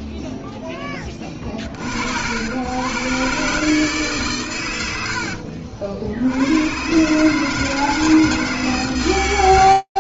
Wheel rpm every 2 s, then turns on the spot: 70, 150, 70, 160, 80.
8-10